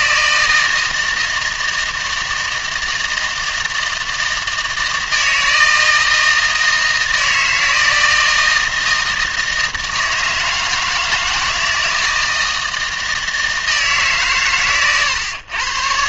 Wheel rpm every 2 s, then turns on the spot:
160, 160, 160, 160, 160, 160, 160, 120.
none